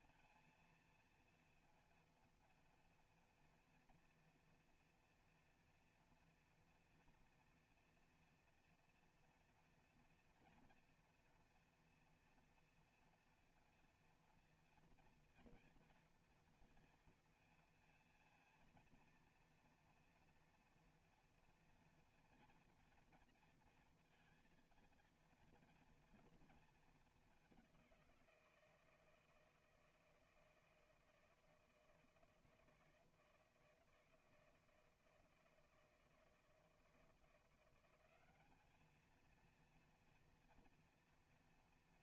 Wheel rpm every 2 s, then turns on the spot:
230, 240, 230, 240, 240, 230, 230, 230, 230, 230, 230, 230, 230, 230, 170, 160, 160, 160, 160, 210, 230.
none